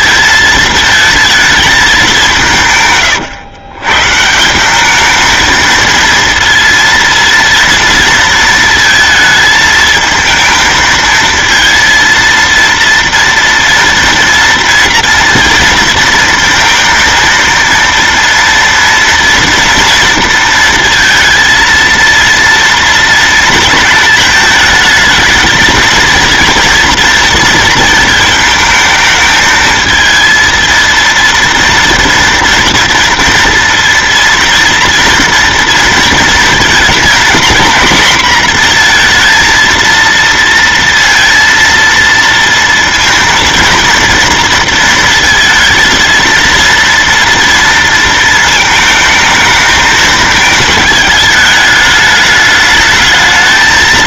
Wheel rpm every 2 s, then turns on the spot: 220, 170, 180, 230, 230, 220, 230, 230, 230, 230, 230, 230, 220, 230, 220, 230, 240, 230, 220, 230, 230, 230, 230, 230, 220, 210, 210.
none